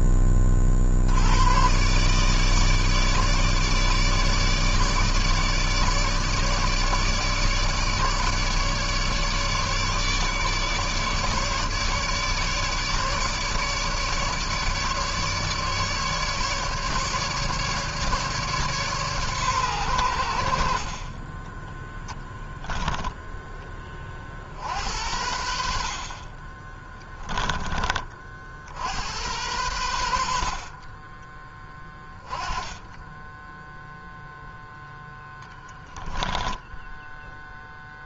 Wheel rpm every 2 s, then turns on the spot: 60, 150, 150, 150, 150, 150, 150, 150, 150, 140, 50, 0, 60, 20, 60, 40, 10, 0, 10.
26-28 36-38